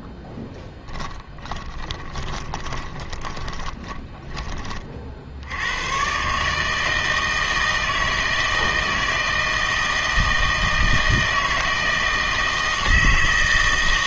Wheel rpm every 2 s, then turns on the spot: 20, 20, 40, 150, 160, 160, 160.
0-4